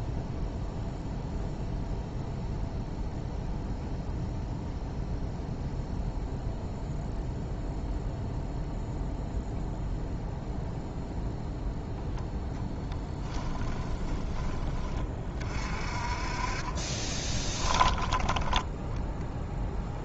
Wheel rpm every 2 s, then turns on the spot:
0, 0, 0, 0, 0, 0, 10, 30, 30, 10.
12-14 16-18